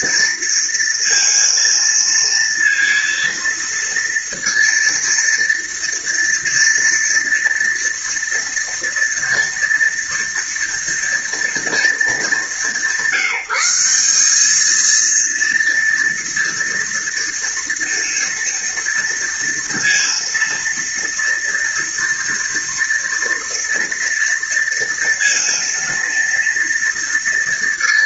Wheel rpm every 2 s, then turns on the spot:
230, 230, 230, 230, 230, 230, 180, 220, 230, 230, 230, 230, 230, 230.
none